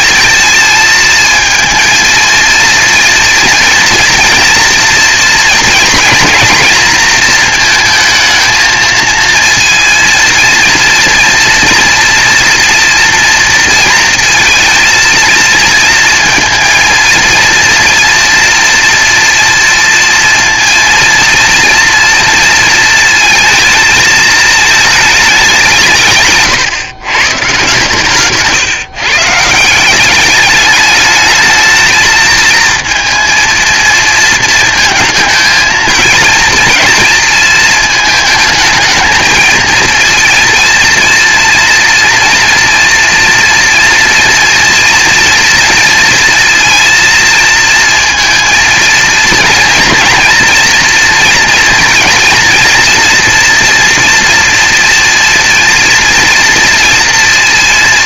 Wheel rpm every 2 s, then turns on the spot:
230, 230, 240, 230, 230, 230, 240, 230, 230, 230, 230, 230, 220, 120, 150, 210, 230, 220, 230, 220, 230, 230, 230, 230, 230, 230, 230, 240, 230.
none